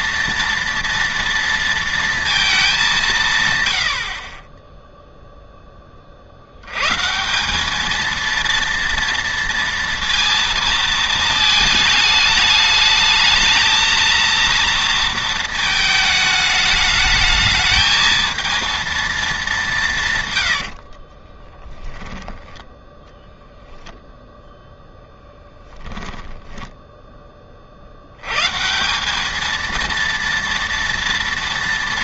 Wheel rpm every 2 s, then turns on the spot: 230, 210, 10, 100, 230, 230, 210, 230, 210, 230, 90, 10, 0, 10, 150, 230.
20-24 26-28